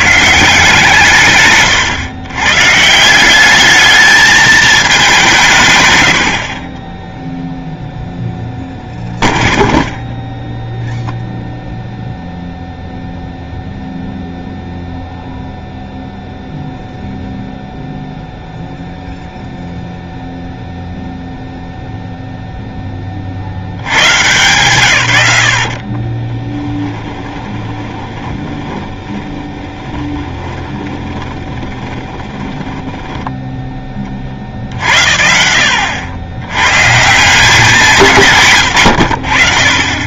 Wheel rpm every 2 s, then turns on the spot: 150, 140, 210, 20, 0, 0, 0, 0, 0, 0, 0, 0, 120, 10, 20, 20, 10, 50, 120, 100.
26-34